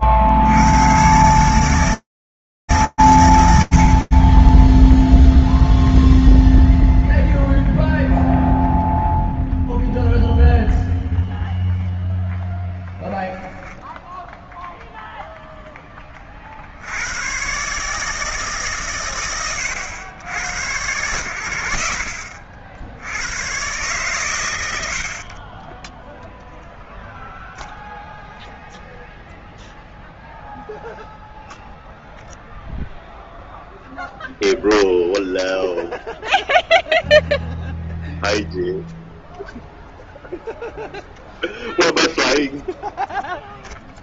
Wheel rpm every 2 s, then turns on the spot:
70, 130, 0, 0, 0, 0, 0, 20, 160, 100, 60, 120, 10, 0, 0, 0, 0, 0, 0, 0, 0, 0.
24-26